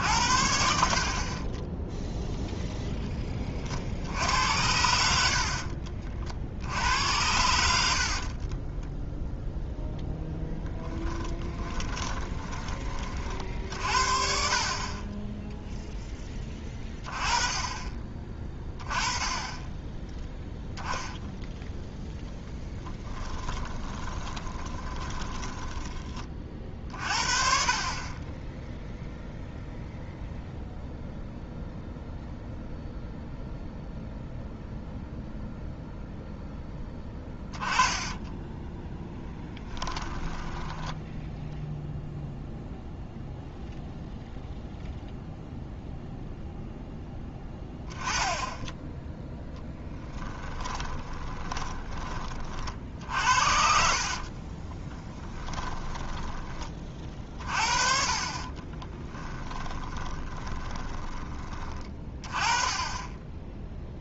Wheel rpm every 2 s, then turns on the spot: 60, 0, 80, 70, 20, 10, 20, 40, 20, 20, 0, 10, 20, 40, 0, 0, 0, 0, 10, 10, 10, 0, 0, 0, 10, 20, 50, 20, 30, 20, 10, 20.
8-12 22-26 36-42 50-52 54-56 58-62